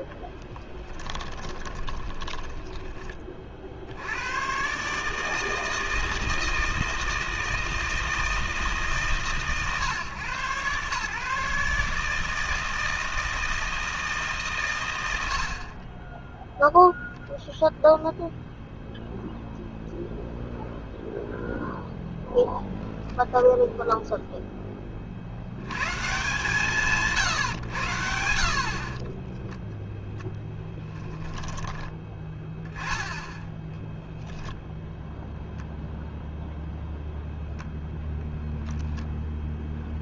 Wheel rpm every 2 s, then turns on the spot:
20, 50, 160, 160, 130, 150, 160, 90, 0, 0, 0, 10, 50, 140, 20, 20, 10, 0, 0, 0.
0-2 28-32